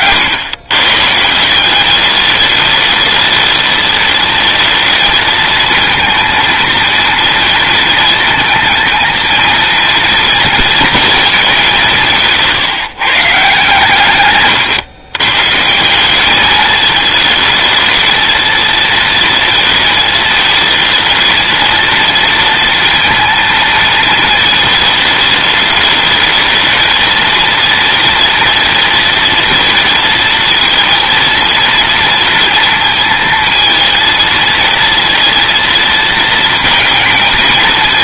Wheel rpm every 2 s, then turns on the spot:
130, 210, 230, 230, 230, 230, 150, 120, 220, 230, 230, 230, 220, 230, 230, 230, 230, 220, 220.
none